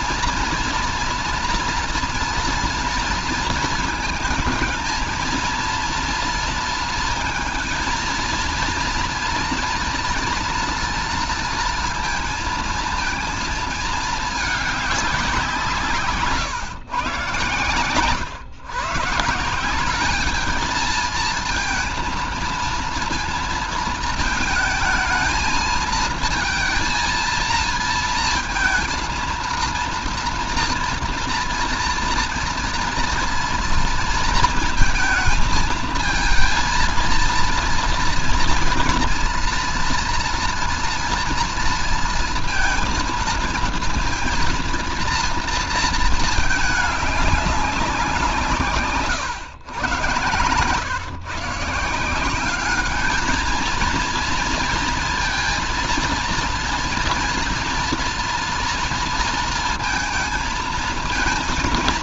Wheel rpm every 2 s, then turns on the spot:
230, 230, 230, 230, 230, 230, 220, 210, 140, 130, 220, 230, 220, 230, 230, 230, 230, 230, 230, 230, 230, 230, 230, 210, 160, 120, 200, 230, 230, 230, 220.
none